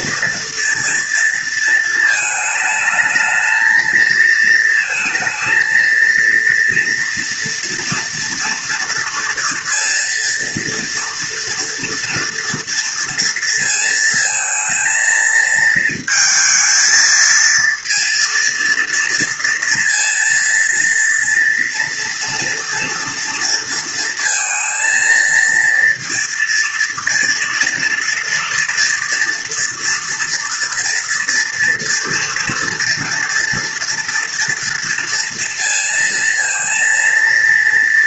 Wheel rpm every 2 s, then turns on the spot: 230, 220, 230, 230, 230, 240, 230, 230, 230, 230, 230, 230, 230, 230, 230, 230, 230, 230, 230.
none